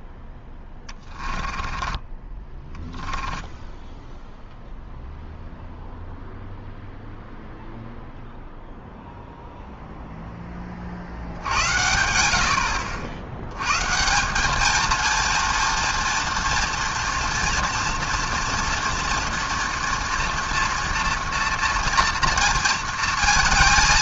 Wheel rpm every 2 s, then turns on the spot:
10, 10, 0, 0, 0, 40, 70, 220, 230, 240, 230, 230.
0-4